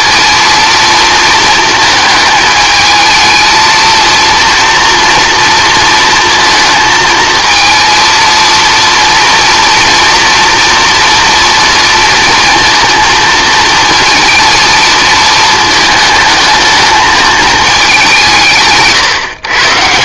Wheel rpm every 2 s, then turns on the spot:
230, 220, 240, 230, 230, 240, 230, 230, 220, 150.
none